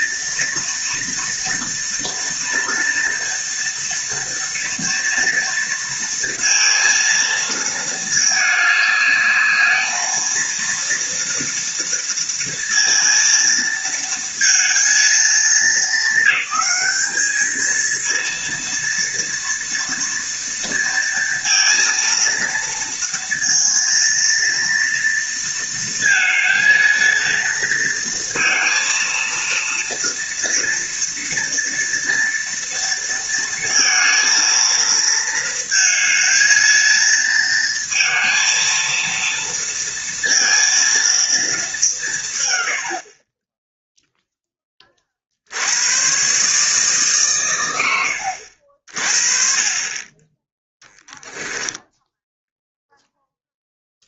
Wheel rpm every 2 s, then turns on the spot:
230, 230, 230, 230, 210, 230, 230, 230, 210, 230, 230, 230, 230, 230, 230, 230, 230, 220, 220, 230, 230, 80, 30, 140, 40, 10, 0.
none